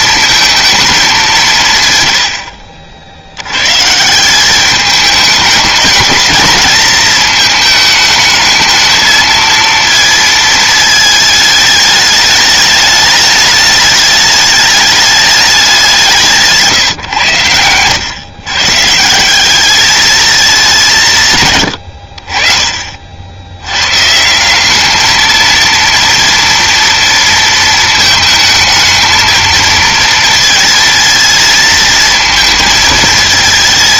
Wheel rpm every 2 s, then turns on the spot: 220, 130, 170, 220, 220, 220, 210, 210, 170, 130, 210, 50, 170, 230, 220, 220, 230.
none